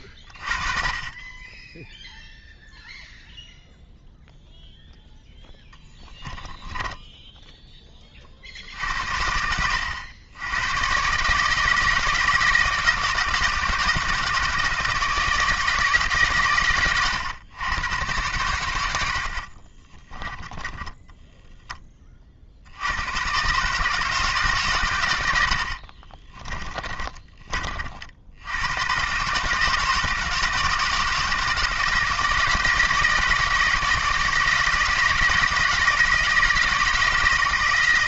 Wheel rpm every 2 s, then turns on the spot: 40, 0, 0, 10, 60, 110, 160, 160, 120, 100, 10, 80, 140, 20, 100, 160, 160, 160, 160.
6-8 20-22 26-28